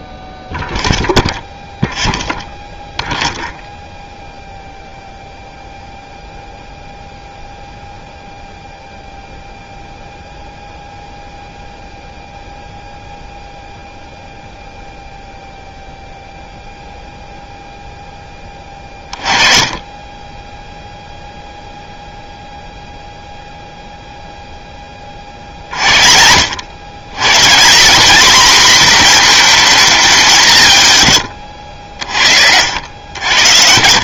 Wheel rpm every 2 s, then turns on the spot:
0, 0, 0, 0, 0, 0, 0, 0, 0, 10, 0, 0, 10, 80, 230, 170, 70.
none